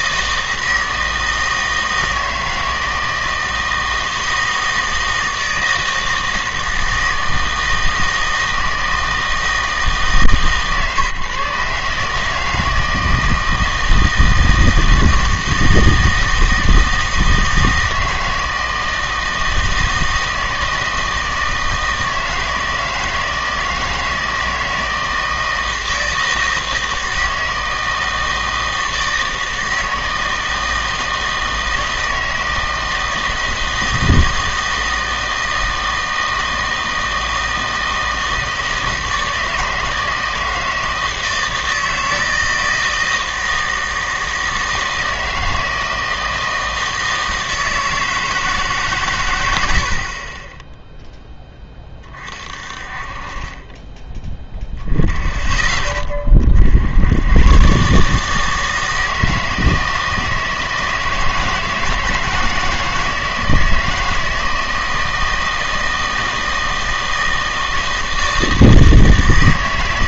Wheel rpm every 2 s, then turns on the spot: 160, 160, 160, 160, 160, 140, 160, 160, 160, 160, 160, 160, 160, 160, 160, 160, 160, 160, 160, 160, 160, 160, 160, 160, 150, 10, 40, 0, 70, 160, 160, 160, 160, 160, 160.
none